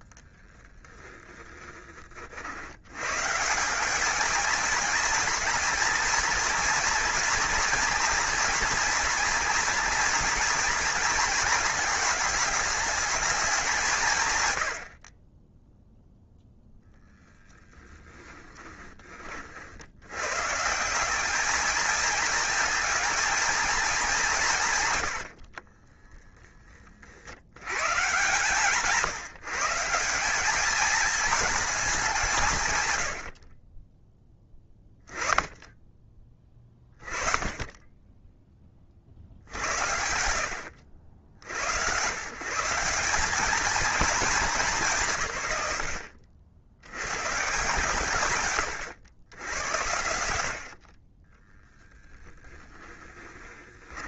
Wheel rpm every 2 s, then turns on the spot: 10, 110, 230, 240, 230, 220, 210, 60, 0, 30, 170, 220, 110, 40, 160, 220, 120, 10, 30, 40, 70, 180, 180, 90, 110, 40, 10.
0-2 18-20